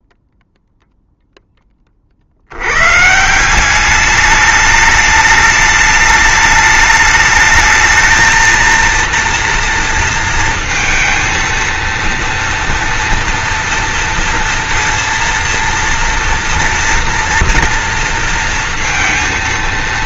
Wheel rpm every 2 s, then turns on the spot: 0, 100, 210, 210, 230, 230, 230, 230, 230, 230.
none